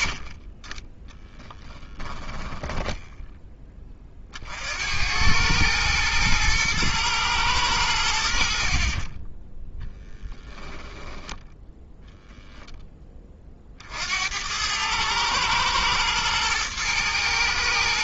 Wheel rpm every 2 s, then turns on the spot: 20, 10, 60, 110, 60, 10, 10, 90, 110.
2-4